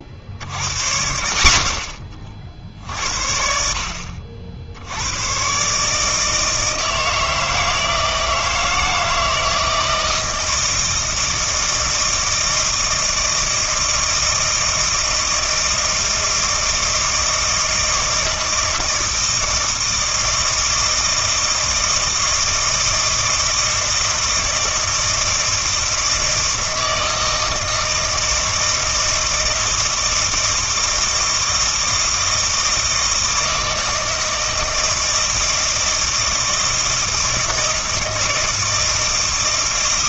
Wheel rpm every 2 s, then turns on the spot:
90, 60, 70, 160, 160, 160, 160, 160, 160, 160, 160, 160, 160, 160, 160, 160, 160, 160, 160, 160.
none